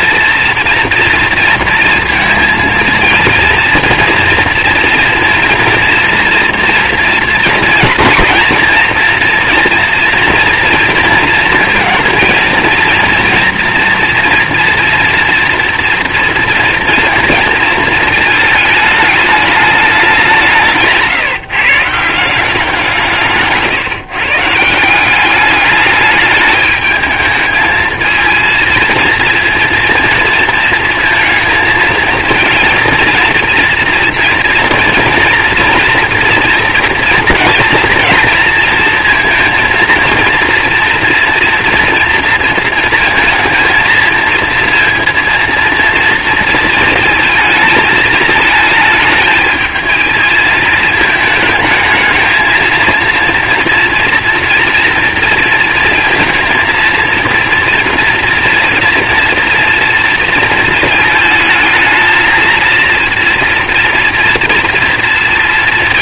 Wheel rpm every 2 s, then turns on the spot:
230, 230, 230, 230, 230, 220, 230, 230, 230, 210, 160, 160, 190, 210, 230, 220, 230, 230, 230, 230, 240, 230, 230, 220, 220, 220, 230, 230, 230, 230, 220, 230, 230.
none